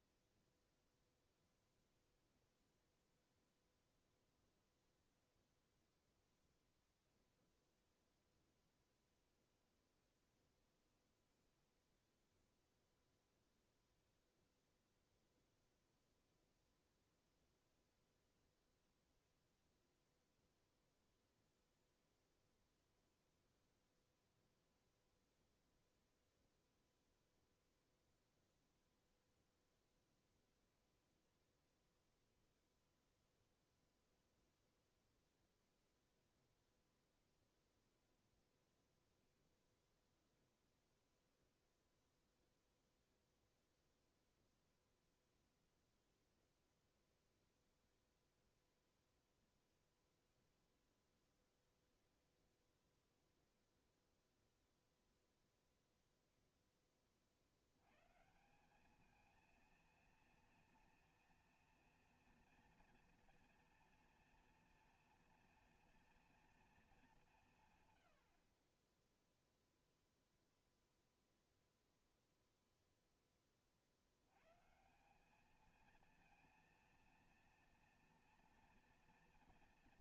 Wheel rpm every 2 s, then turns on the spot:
0, 0, 0, 0, 0, 0, 0, 0, 0, 0, 0, 0, 0, 0, 0, 0, 0, 0, 0, 0, 0, 0, 0, 0, 0, 0, 0, 0, 40, 220, 230, 230, 230, 200, 0, 0, 10, 190, 230, 240.
none